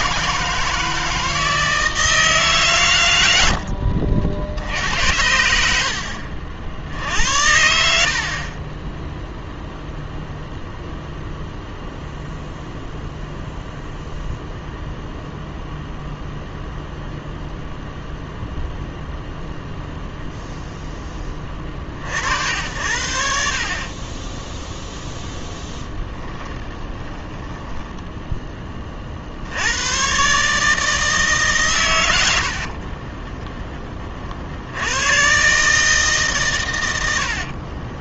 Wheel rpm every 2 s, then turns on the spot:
160, 130, 80, 60, 10, 0, 0, 0, 0, 0, 0, 70, 0, 20, 30, 160, 40, 80, 110.
4-6 26-28 32-34